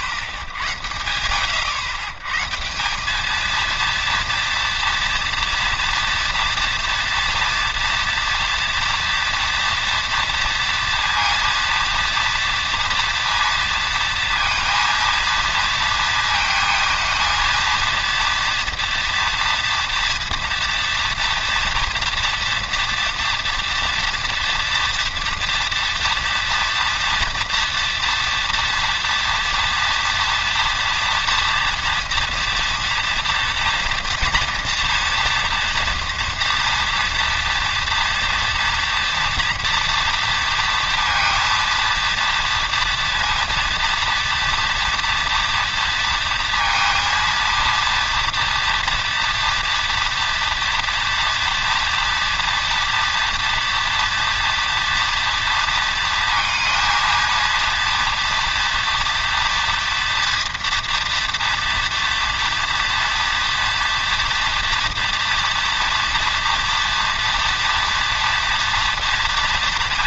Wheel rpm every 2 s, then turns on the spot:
70, 170, 230, 230, 240, 230, 230, 230, 230, 230, 230, 230, 230, 230, 230, 230, 230, 240, 230, 230, 230, 230, 240, 230, 230, 230, 230, 230, 220, 240, 230, 240, 240, 240, 230.
none